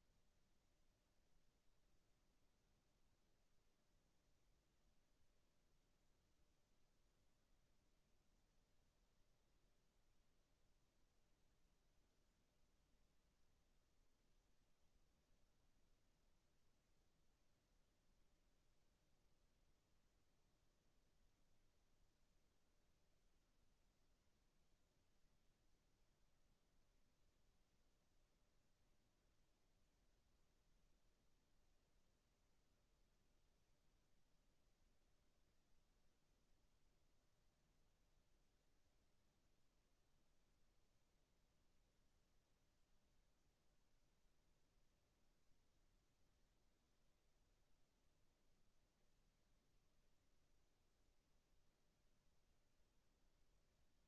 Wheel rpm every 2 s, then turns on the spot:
0, 0, 0, 0, 0, 0, 0, 0, 0, 0, 0, 0, 0, 0, 0, 0, 0, 0, 0, 0, 0, 0, 0, 0, 0, 0, 0.
none